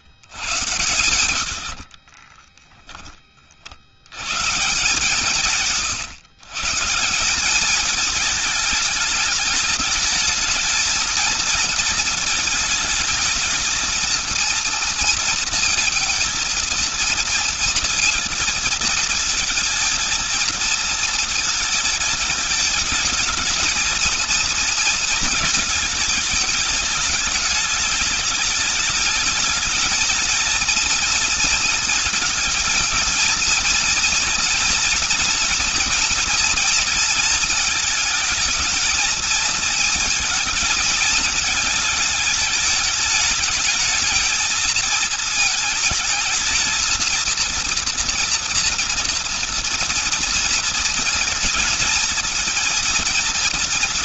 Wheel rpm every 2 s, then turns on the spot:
100, 40, 160, 180, 210, 230, 220, 230, 230, 220, 220, 220, 230, 210, 210, 230, 230, 240, 230, 220, 220, 210, 220, 230, 230, 230, 230.
none